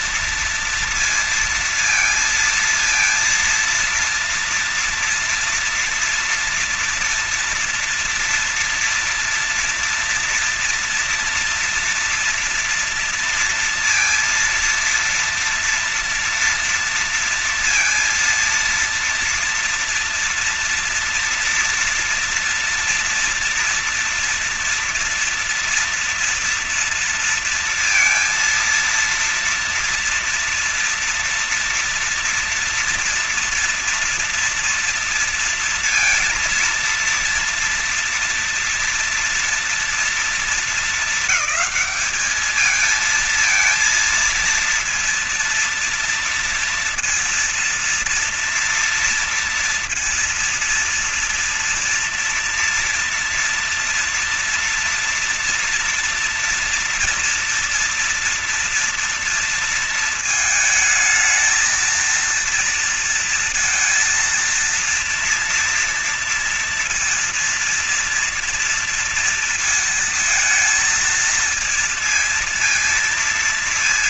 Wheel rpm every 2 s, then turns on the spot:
230, 230, 230, 240, 240, 240, 230, 230, 230, 230, 240, 230, 230, 230, 230, 230, 230, 230, 230, 230, 230, 220, 230, 230, 230, 230, 230, 230, 230, 240, 230, 230, 230, 230, 230, 220, 230.
none